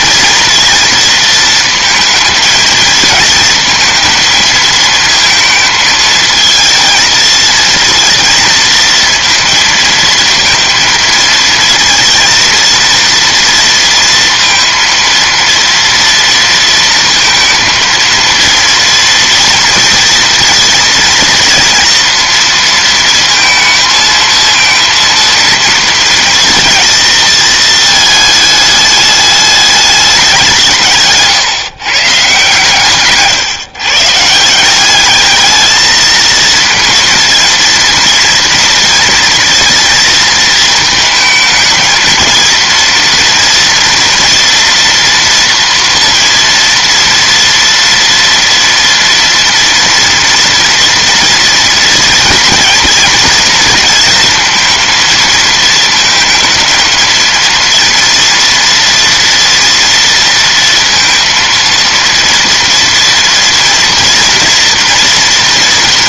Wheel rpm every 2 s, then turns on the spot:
230, 220, 230, 220, 230, 230, 230, 230, 230, 230, 230, 230, 230, 230, 210, 180, 140, 180, 230, 230, 220, 230, 240, 230, 230, 230, 230, 220, 220, 240, 230, 230, 240.
none